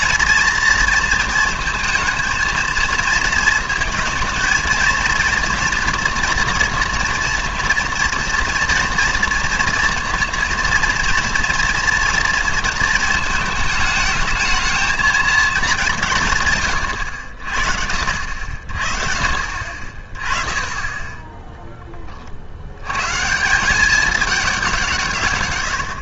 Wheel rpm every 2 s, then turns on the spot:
230, 230, 230, 230, 240, 230, 230, 220, 130, 50, 20, 80, 190.
none